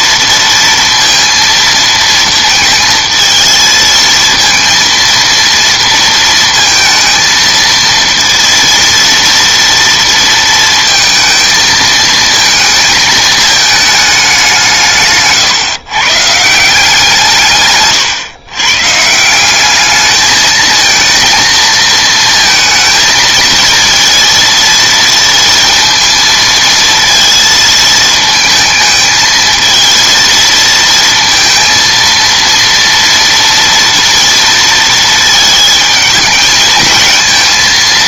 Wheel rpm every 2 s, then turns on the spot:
230, 220, 230, 230, 230, 230, 220, 170, 170, 130, 220, 220, 230, 230, 220, 230, 230, 230, 220.
none